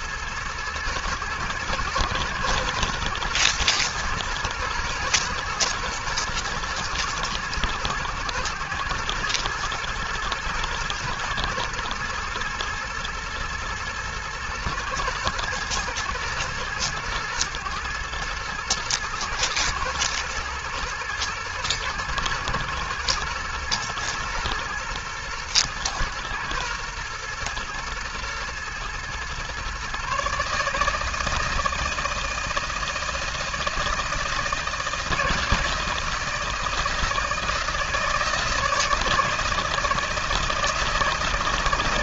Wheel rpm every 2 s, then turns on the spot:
110, 120, 120, 110, 120, 120, 120, 110, 110, 120, 120, 110, 120, 120, 120, 160, 160, 160, 160, 160, 160.
none